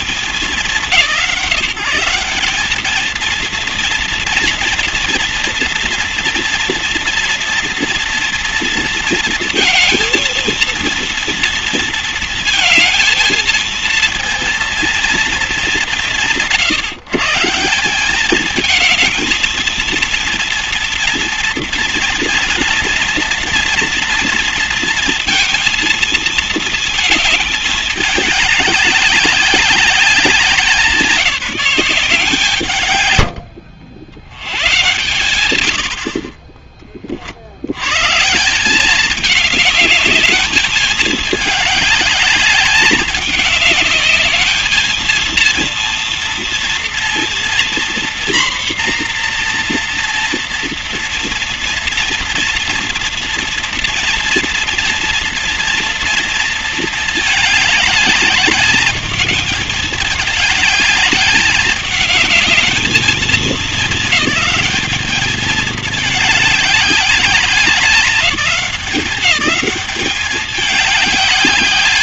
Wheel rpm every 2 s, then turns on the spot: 190, 220, 230, 230, 230, 230, 230, 230, 150, 220, 230, 230, 240, 230, 200, 180, 140, 120, 40, 190, 210, 200, 220, 230, 240, 230, 240, 230, 220, 210, 210, 210, 210, 210, 200, 200.
none